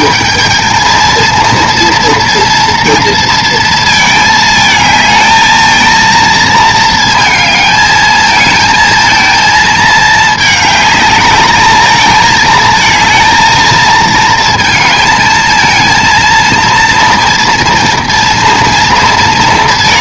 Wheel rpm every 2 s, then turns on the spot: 230, 230, 220, 220, 230, 210, 230, 220, 230, 230.
none